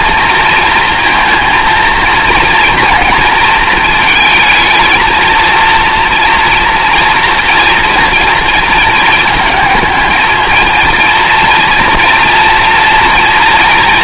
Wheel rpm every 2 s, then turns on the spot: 230, 230, 220, 230, 220, 220, 230.
none